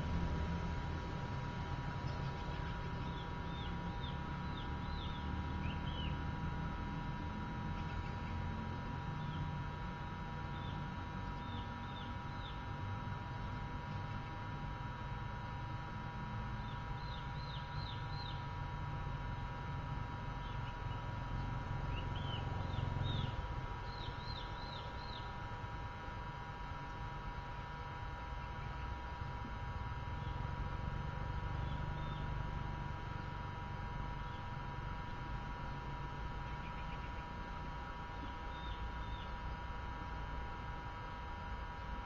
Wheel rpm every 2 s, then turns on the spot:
0, 0, 0, 0, 0, 0, 0, 0, 0, 0, 0, 0, 0, 0, 0, 0, 0, 0, 0, 0, 0.
none